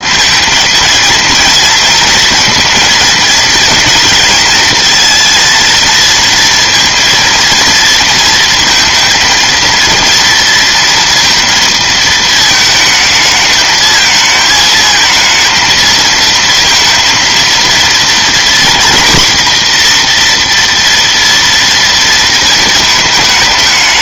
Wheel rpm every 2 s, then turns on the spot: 230, 230, 230, 230, 230, 230, 220, 220, 230, 240, 240, 220.
none